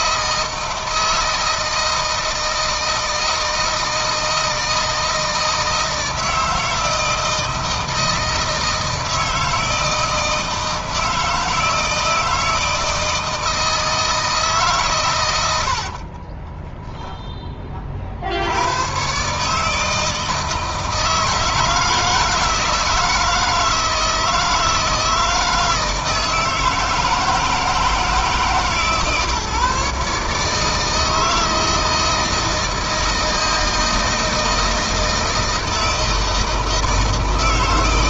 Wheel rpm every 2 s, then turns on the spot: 160, 160, 160, 160, 160, 160, 160, 140, 20, 90, 160, 160, 160, 160, 150, 150, 160, 160, 160.
16-18